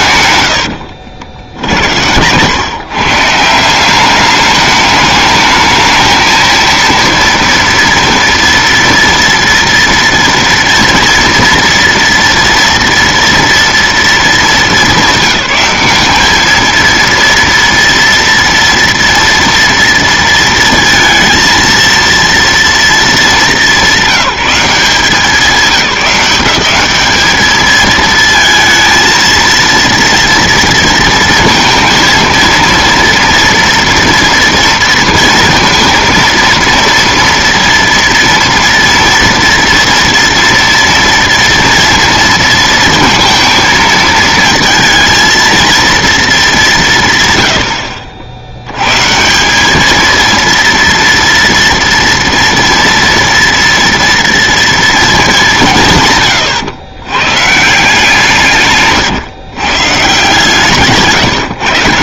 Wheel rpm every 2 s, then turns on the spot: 90, 130, 210, 230, 240, 230, 230, 210, 220, 230, 230, 230, 180, 190, 220, 230, 230, 230, 230, 230, 230, 230, 220, 200, 90, 230, 230, 230, 120, 150, 150.
0-2